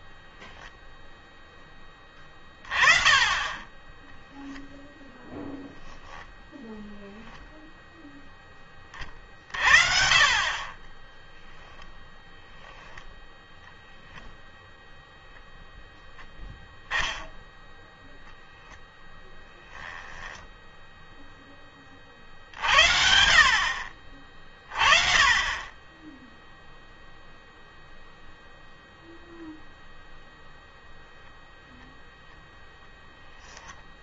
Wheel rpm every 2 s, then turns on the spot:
0, 30, 10, 10, 10, 50, 0, 0, 10, 0, 10, 50, 40, 10, 0, 0, 0.
4-6